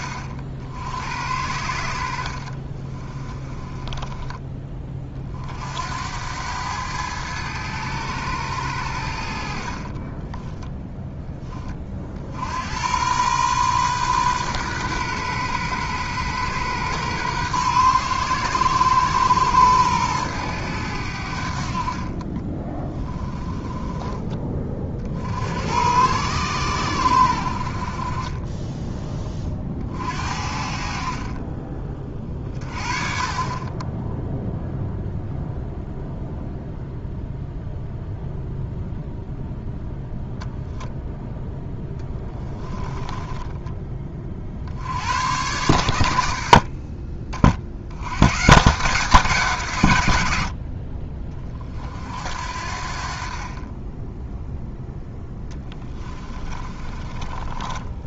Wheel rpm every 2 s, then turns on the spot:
70, 40, 30, 100, 100, 10, 90, 120, 120, 120, 100, 20, 40, 100, 20, 60, 30, 0, 0, 0, 0, 10, 60, 50, 160, 60, 60, 0, 30.
2-4 22-24 42-44 56-58